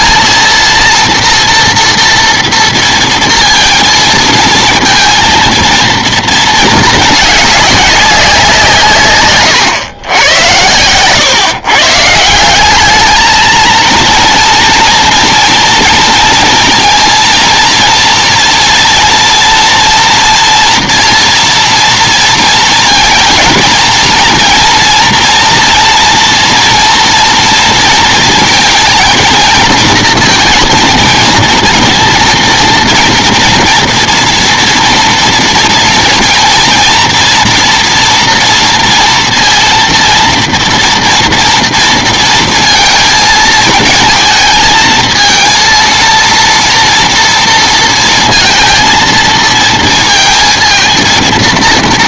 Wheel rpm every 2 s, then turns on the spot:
220, 230, 230, 230, 200, 120, 130, 230, 230, 230, 230, 230, 220, 240, 230, 230, 230, 230, 230, 230, 230, 230, 220, 230, 230, 230.
none